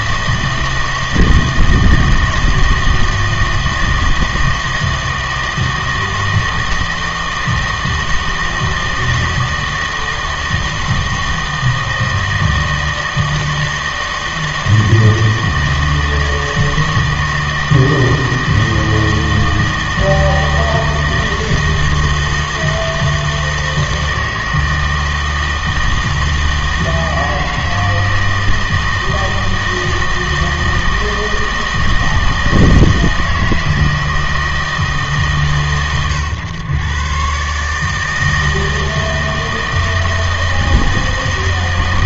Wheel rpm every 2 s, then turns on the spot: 160, 160, 160, 160, 160, 160, 160, 160, 160, 160, 160, 160, 160, 160, 160, 160, 160, 160, 120, 160, 160.
none